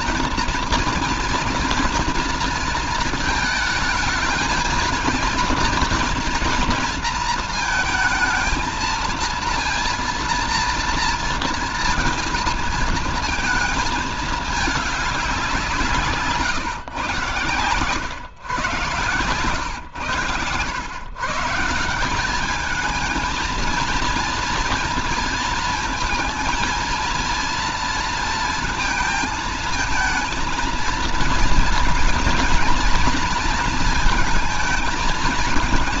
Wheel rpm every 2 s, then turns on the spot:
230, 230, 220, 230, 220, 230, 230, 210, 130, 120, 110, 190, 230, 230, 230, 230, 230, 220.
20-22